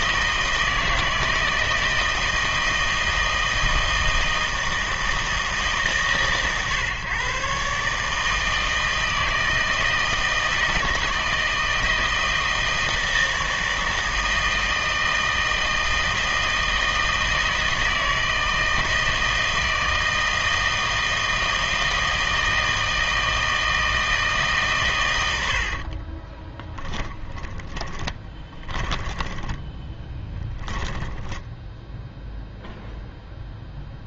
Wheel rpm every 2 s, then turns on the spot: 160, 160, 160, 130, 160, 160, 160, 160, 160, 160, 160, 160, 140, 30, 20, 10, 0.
26-32